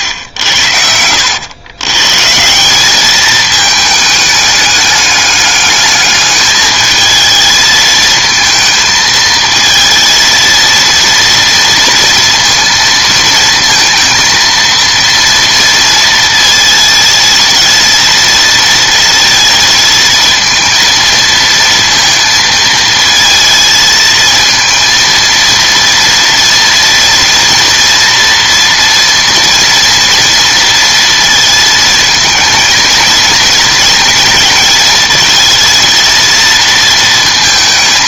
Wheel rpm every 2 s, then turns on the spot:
90, 160, 210, 210, 220, 230, 230, 230, 230, 230, 230, 230, 220, 230, 230, 230, 220, 230, 230.
none